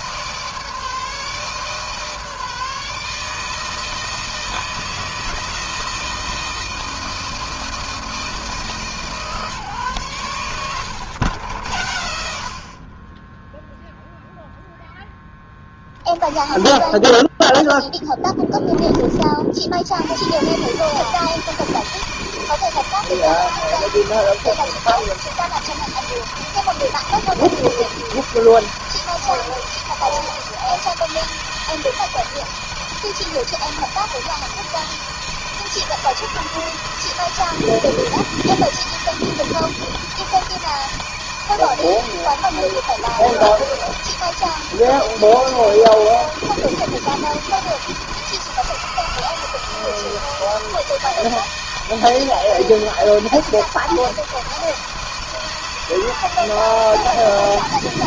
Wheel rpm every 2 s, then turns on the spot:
160, 150, 160, 160, 150, 100, 70, 0, 30, 10, 100, 160, 160, 160, 160, 160, 160, 160, 160, 160, 160, 160, 160, 160, 170, 160, 160, 160, 160.
none